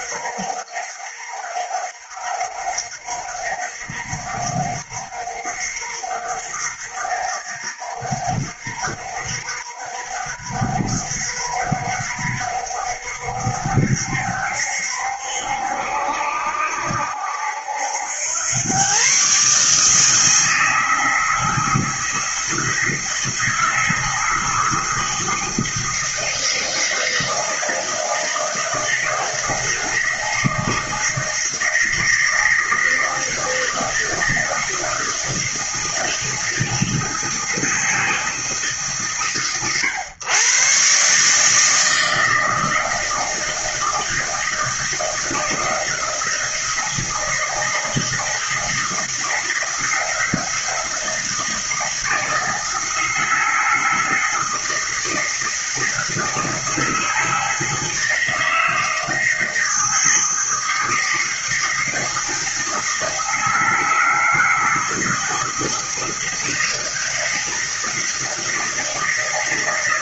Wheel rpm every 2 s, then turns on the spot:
60, 60, 60, 60, 60, 60, 60, 70, 70, 130, 160, 160, 160, 160, 160, 160, 160, 160, 160, 130, 140, 160, 160, 160, 160, 170, 160, 160, 160, 160, 160, 160, 160, 160, 160.
none